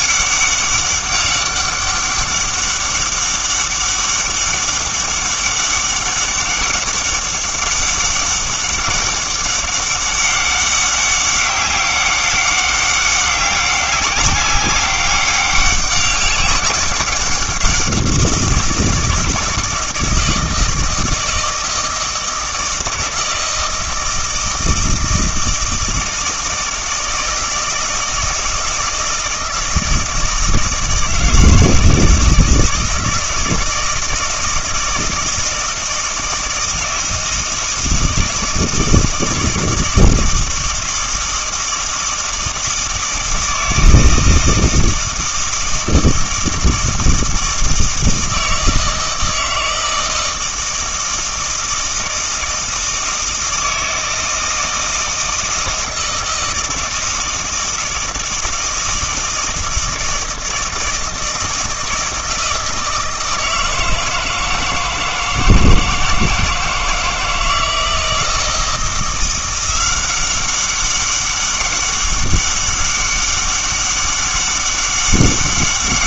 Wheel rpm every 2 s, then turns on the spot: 200, 200, 200, 200, 200, 200, 200, 200, 200, 170, 160, 160, 160, 160, 160, 160, 160, 160, 160, 160, 160, 160, 160, 160, 160, 160, 160, 160, 160, 160, 160, 160, 160, 160, 170, 190, 200, 200.
none